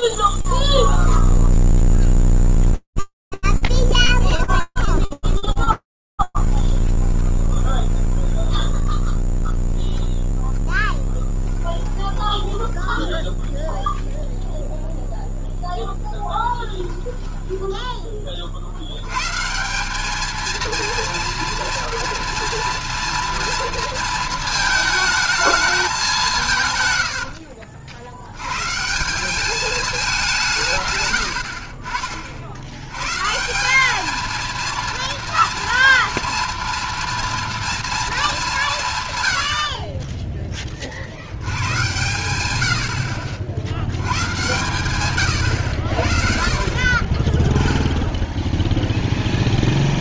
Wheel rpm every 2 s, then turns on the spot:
0, 0, 20, 10, 0, 10, 0, 0, 10, 140, 230, 230, 220, 70, 190, 90, 150, 230, 230, 120, 80, 60, 110, 20, 0.
4-8 10-12 16-18 26-28 30-32